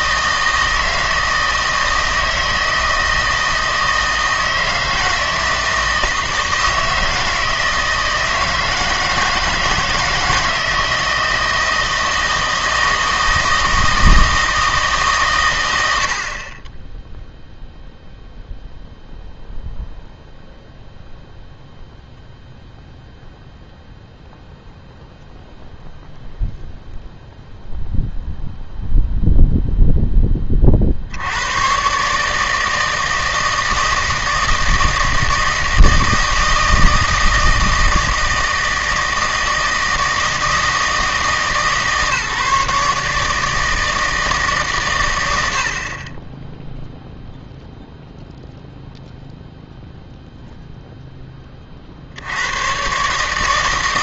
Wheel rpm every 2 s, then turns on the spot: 160, 160, 160, 160, 160, 160, 160, 160, 20, 0, 0, 0, 0, 0, 0, 50, 160, 160, 160, 160, 160, 150, 130, 0, 0, 0, 110.
none